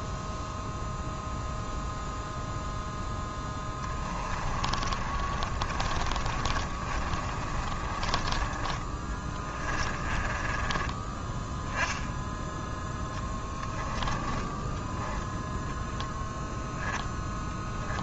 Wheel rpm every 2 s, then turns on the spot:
0, 0, 30, 30, 20, 20, 10, 10, 0.
4-8 10-14